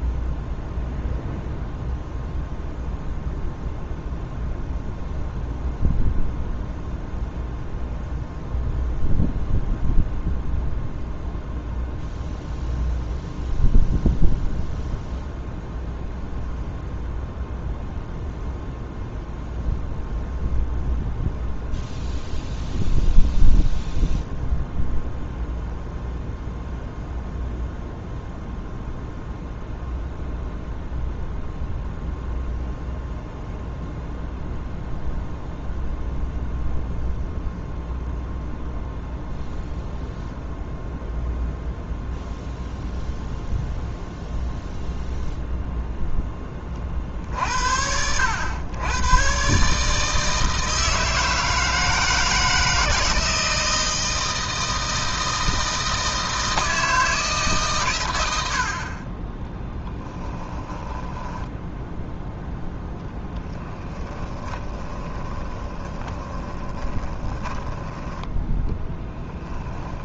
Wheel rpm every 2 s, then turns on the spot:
0, 0, 0, 0, 0, 0, 0, 0, 0, 0, 0, 0, 0, 0, 0, 0, 0, 0, 0, 0, 0, 0, 0, 40, 100, 160, 160, 160, 160, 50, 10, 0, 20, 20, 10.
60-62 64-68